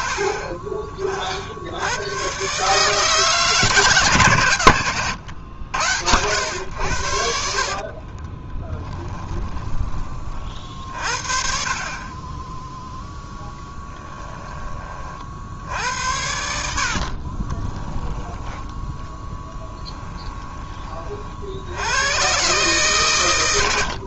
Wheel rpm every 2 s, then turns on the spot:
50, 150, 100, 80, 20, 50, 0, 40, 50, 10, 40, 120.
4-6 8-10 16-18